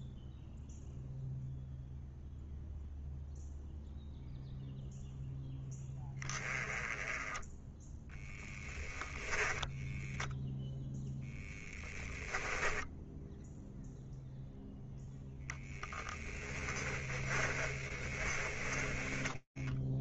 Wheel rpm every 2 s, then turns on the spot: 0, 0, 10, 10, 10, 10, 0, 10, 20, 0.
8-10 16-18